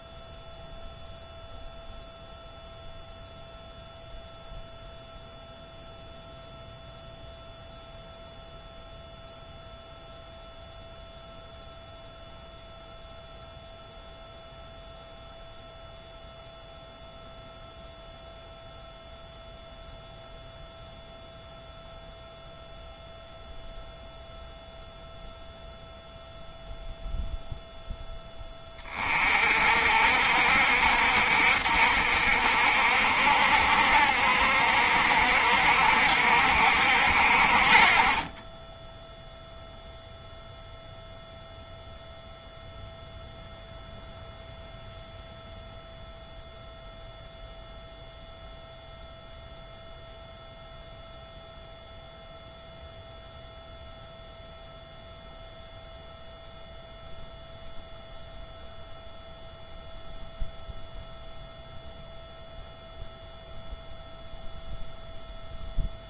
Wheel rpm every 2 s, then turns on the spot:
0, 0, 0, 0, 0, 0, 0, 0, 0, 0, 0, 0, 0, 0, 30, 60, 60, 60, 60, 10, 0, 0, 0, 0, 0, 0, 0, 0, 0, 0, 0, 0, 0.
none